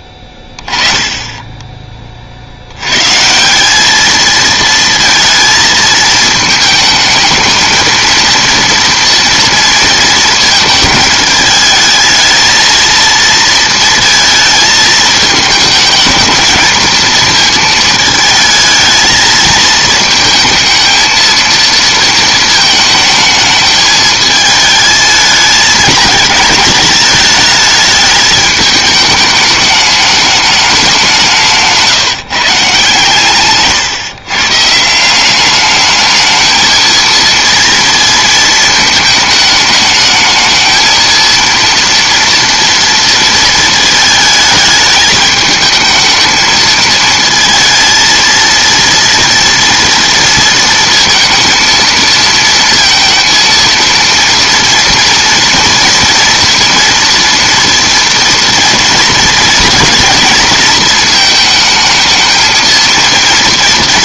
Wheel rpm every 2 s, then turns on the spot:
10, 80, 230, 220, 230, 220, 220, 220, 220, 220, 220, 220, 220, 220, 210, 200, 150, 140, 220, 220, 220, 230, 210, 220, 230, 230, 230, 230, 230, 230, 230, 220.
none